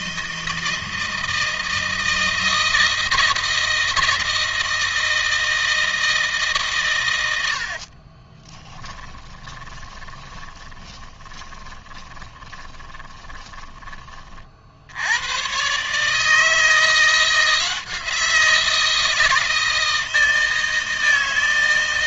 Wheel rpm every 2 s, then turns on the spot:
160, 160, 160, 150, 20, 20, 20, 50, 160, 170, 160.
8-14